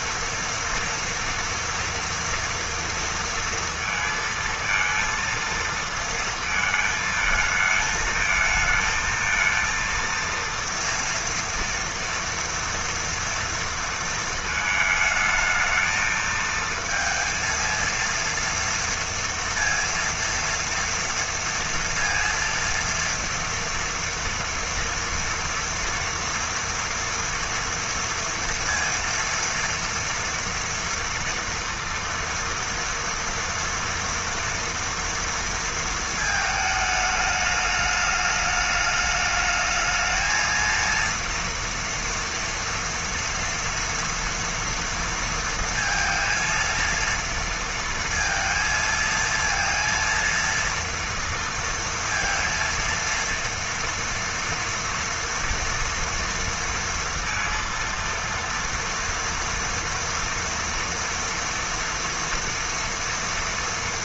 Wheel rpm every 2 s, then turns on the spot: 240, 230, 230, 220, 220, 230, 230, 220, 230, 230, 230, 230, 230, 230, 230, 230, 230, 230, 220, 210, 230, 230, 230, 230, 230, 230, 230, 230, 230, 230, 230, 230.
none